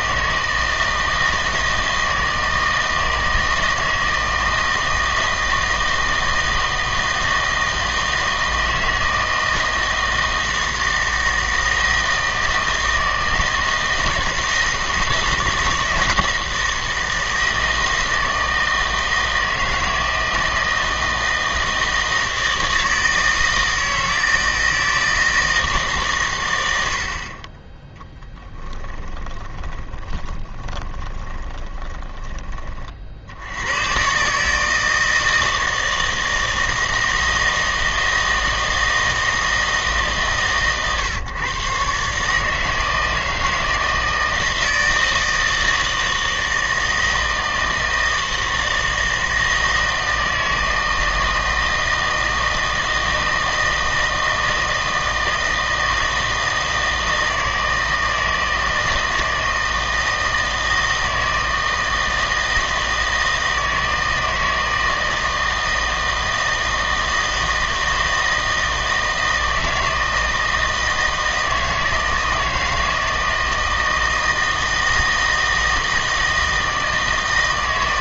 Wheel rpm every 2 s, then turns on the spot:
160, 160, 160, 160, 160, 160, 160, 160, 160, 160, 160, 160, 160, 100, 10, 20, 30, 160, 160, 160, 140, 160, 160, 160, 160, 160, 160, 160, 160, 160, 160, 160, 160, 160, 160, 160, 160, 160, 160.
28-32